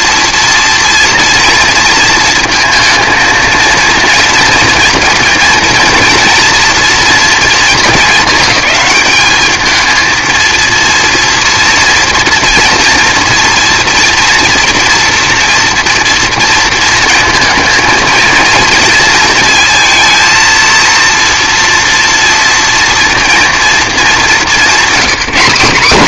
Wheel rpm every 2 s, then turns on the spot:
240, 230, 230, 230, 220, 230, 230, 240, 230, 230, 230, 230, 200.
none